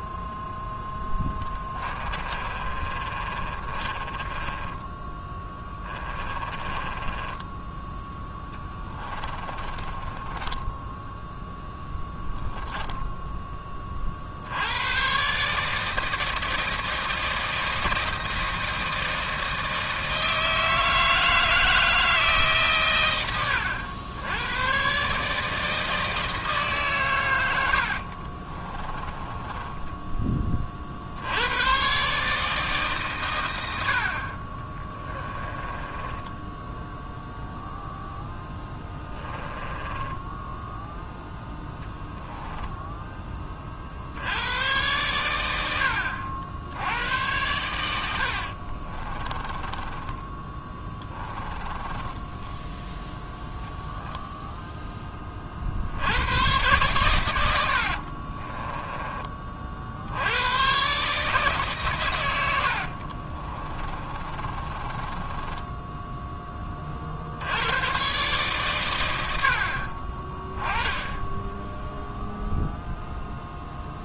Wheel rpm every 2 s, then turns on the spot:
0, 30, 20, 20, 10, 10, 10, 80, 160, 160, 160, 140, 110, 150, 30, 40, 150, 30, 10, 10, 10, 10, 120, 90, 50, 20, 10, 0, 120, 20, 120, 70, 30, 30, 120, 10, 0.
2-12 28-30 34-40 48-54 58-60 62-66